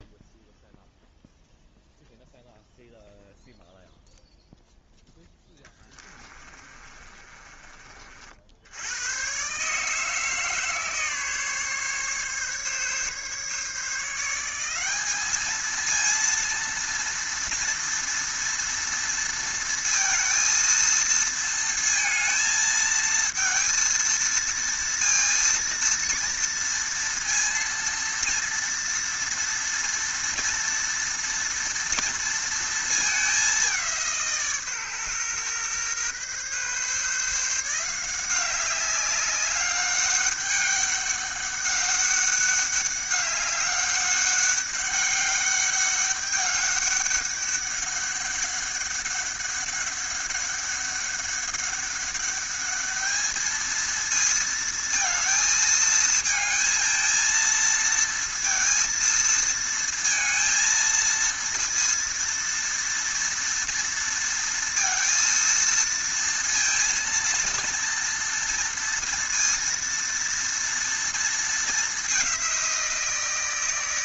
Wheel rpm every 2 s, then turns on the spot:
0, 0, 0, 30, 100, 150, 140, 200, 230, 230, 230, 230, 230, 230, 230, 230, 220, 130, 140, 200, 200, 200, 200, 200, 200, 200, 210, 230, 220, 220, 230, 230, 230, 230, 230, 230, 170.
6-8